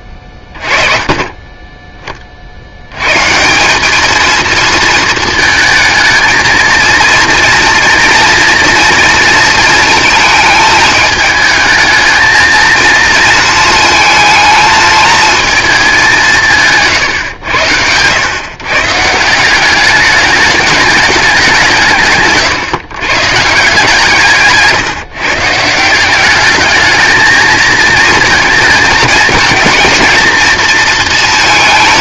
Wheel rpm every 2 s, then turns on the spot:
30, 80, 230, 230, 230, 220, 230, 220, 150, 140, 210, 140, 150, 210, 220, 220.
16-18